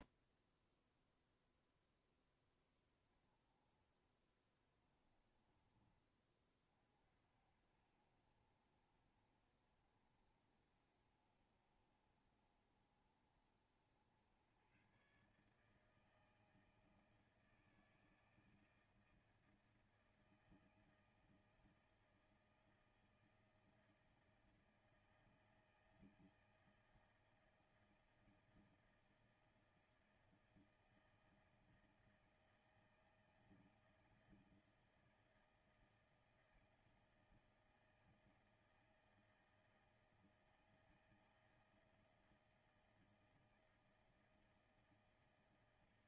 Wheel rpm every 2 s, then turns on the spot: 0, 10, 20, 30, 50, 50, 50, 80, 160, 160, 160, 160, 160, 160, 160, 160, 160, 160, 160, 160, 160, 160, 160.
4-6